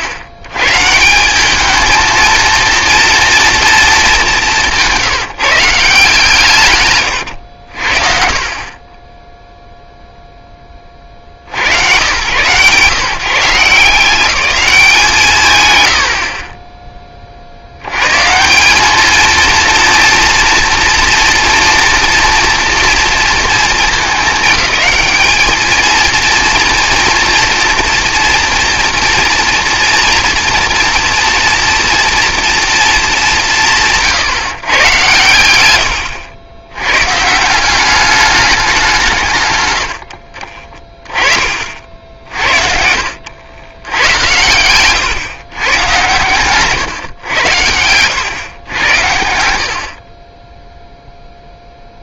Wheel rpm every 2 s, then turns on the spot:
120, 230, 170, 130, 30, 30, 140, 190, 10, 190, 230, 230, 220, 240, 230, 230, 230, 130, 100, 200, 40, 50, 110, 130, 110, 10.
none